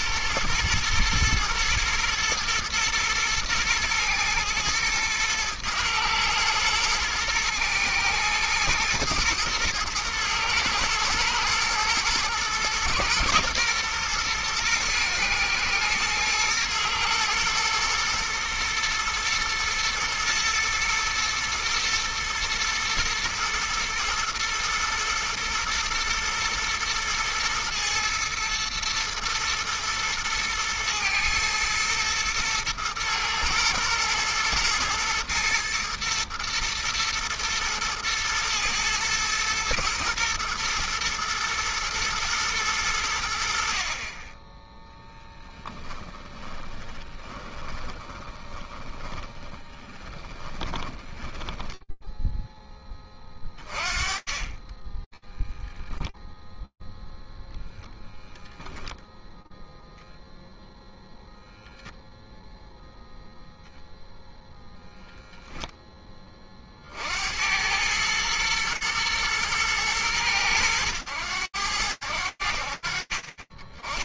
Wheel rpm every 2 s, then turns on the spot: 110, 110, 110, 110, 110, 120, 120, 120, 120, 110, 120, 110, 110, 120, 110, 110, 110, 110, 110, 110, 110, 100, 10, 20, 10, 10, 20, 10, 0, 0, 0, 0, 10, 110, 110, 70, 10.
46-52 72-74